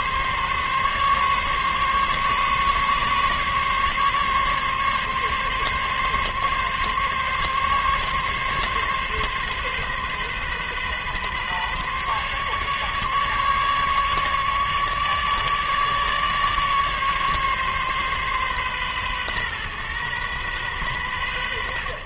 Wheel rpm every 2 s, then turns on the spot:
140, 140, 140, 140, 140, 130, 140, 150, 150, 130, 110.
none